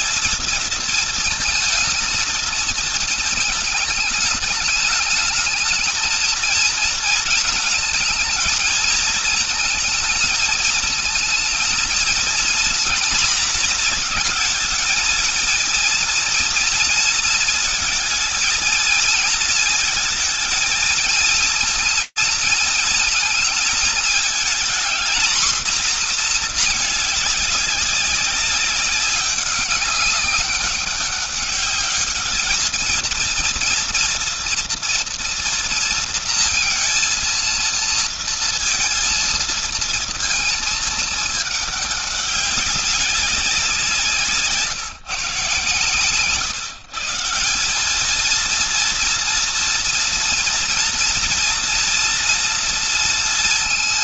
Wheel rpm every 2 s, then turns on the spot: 230, 220, 210, 230, 220, 230, 240, 220, 230, 220, 230, 230, 240, 210, 200, 200, 230, 240, 230, 230, 220, 200, 150, 160, 230, 230, 230.
none